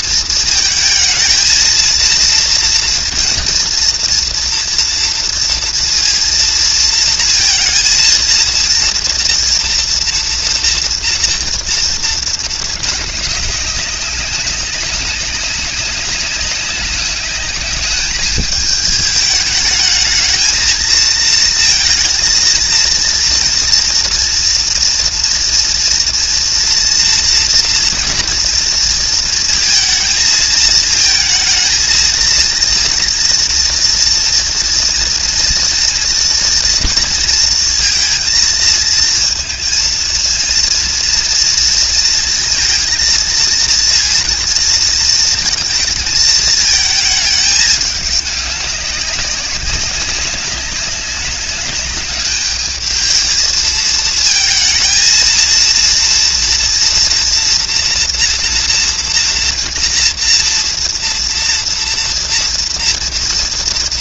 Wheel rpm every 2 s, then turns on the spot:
220, 230, 230, 230, 230, 230, 210, 200, 190, 210, 220, 230, 230, 230, 230, 220, 230, 230, 230, 220, 230, 230, 230, 220, 200, 200, 210, 230, 240, 230, 230, 230.
none